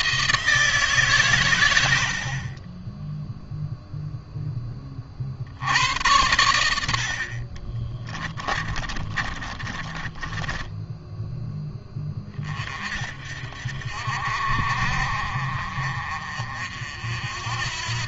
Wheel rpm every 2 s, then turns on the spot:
160, 30, 20, 90, 30, 10, 40, 50, 50.
8-12